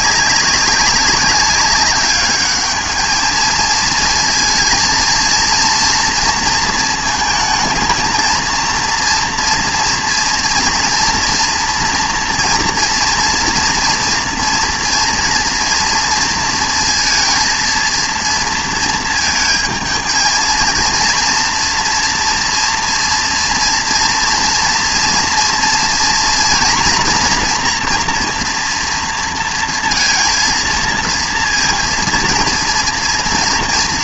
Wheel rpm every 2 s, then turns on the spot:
190, 210, 230, 230, 230, 230, 230, 230, 230, 230, 230, 230, 230, 230, 240, 230, 230.
none